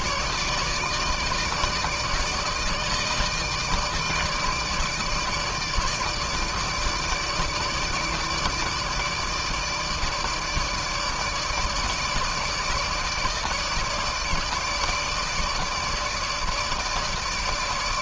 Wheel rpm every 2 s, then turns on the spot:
150, 160, 160, 160, 160, 160, 160, 160, 160.
none